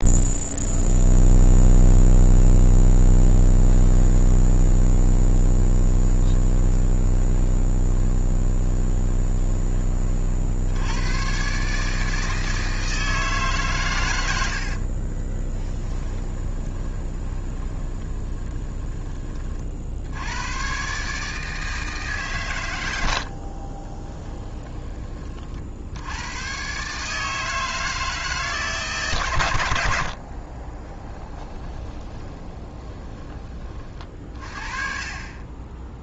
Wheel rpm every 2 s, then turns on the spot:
0, 0, 20, 10, 20, 70, 160, 70, 20, 20, 110, 130, 10, 110, 160, 40, 20, 40.
4-10 14-20 24-26 30-34